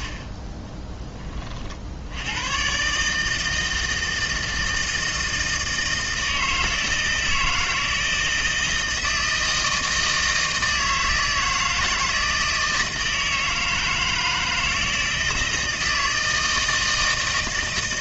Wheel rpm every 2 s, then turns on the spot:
10, 130, 160, 160, 160, 160, 160, 160, 160.
none